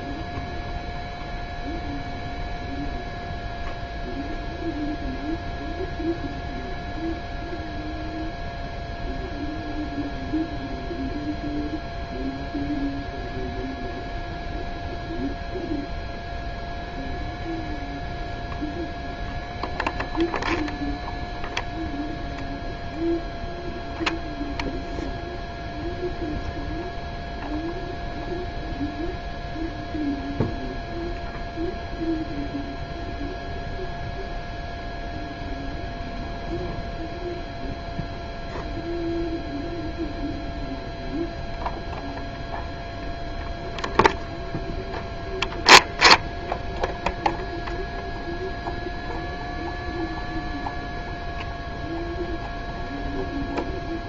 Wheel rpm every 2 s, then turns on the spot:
0, 0, 0, 0, 0, 0, 0, 0, 0, 0, 0, 0, 0, 0, 0, 0, 0, 0, 0, 0, 0, 0, 0, 0, 0, 0, 0.
none